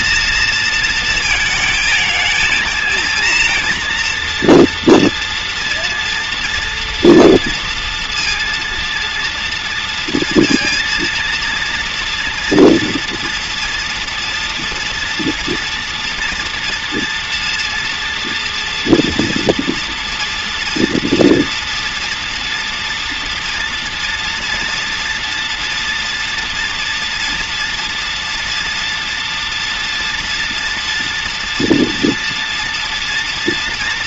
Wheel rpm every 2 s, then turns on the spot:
230, 230, 230, 230, 230, 230, 240, 230, 240, 230, 230, 240, 230, 230, 240, 230, 240.
none